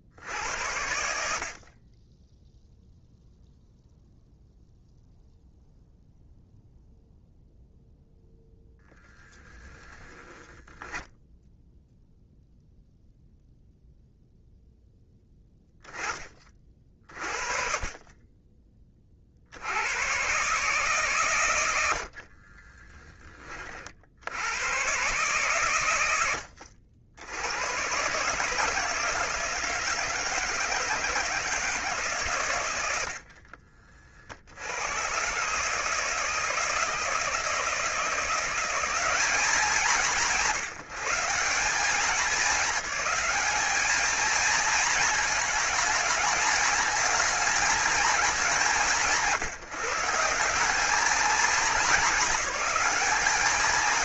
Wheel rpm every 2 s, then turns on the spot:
70, 0, 0, 0, 0, 0, 0, 0, 30, 30, 140, 30, 120, 70, 160, 160, 100, 90, 160, 190, 170, 210, 220, 220, 180, 210, 220.
22-24